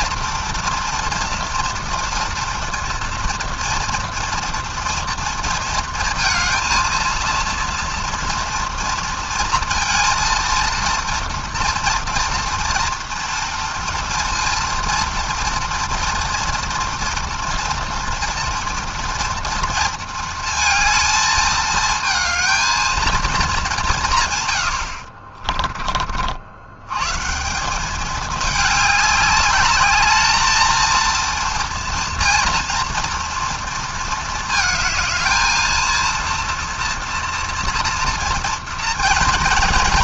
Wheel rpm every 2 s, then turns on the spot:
230, 240, 230, 230, 230, 230, 230, 230, 230, 230, 220, 220, 50, 140, 210, 230, 230, 220, 240, 230.
24-26